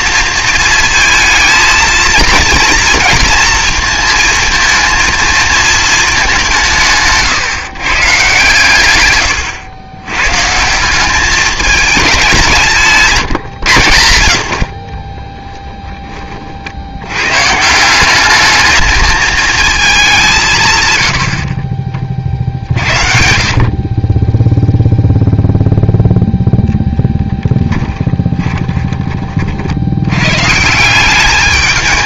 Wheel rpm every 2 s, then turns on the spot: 230, 230, 230, 180, 130, 150, 180, 70, 50, 210, 150, 60, 0, 0, 20, 140.
28-30